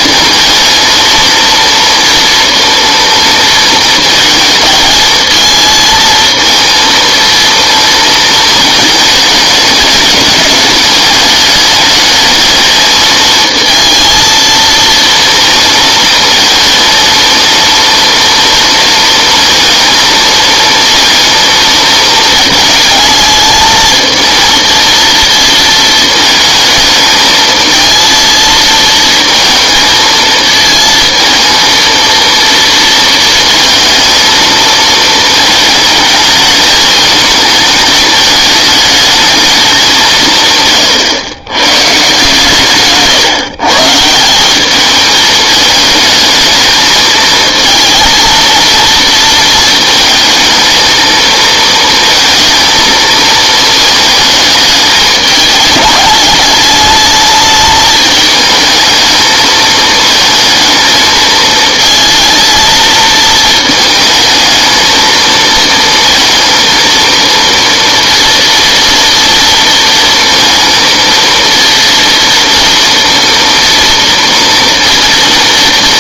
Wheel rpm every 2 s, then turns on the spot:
230, 230, 220, 230, 220, 210, 220, 230, 230, 230, 230, 220, 230, 220, 220, 220, 230, 220, 220, 210, 130, 140, 210, 220, 230, 220, 230, 210, 210, 220, 230, 220, 220, 230, 240, 230, 240, 230.
none